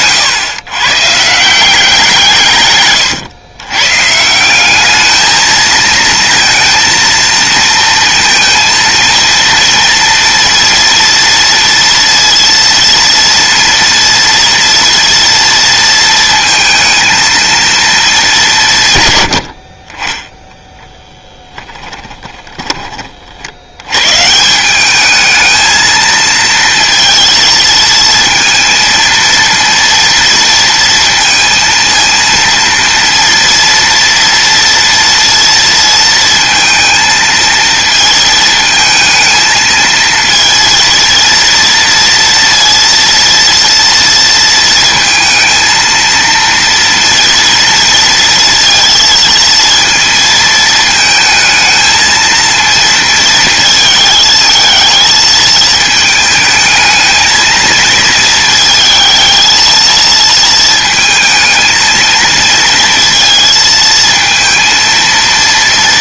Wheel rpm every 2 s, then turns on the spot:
130, 130, 200, 230, 230, 240, 230, 230, 230, 140, 10, 20, 200, 230, 230, 230, 230, 230, 230, 220, 230, 230, 230, 230, 230, 220, 230, 220, 220, 220, 220, 230, 230.
none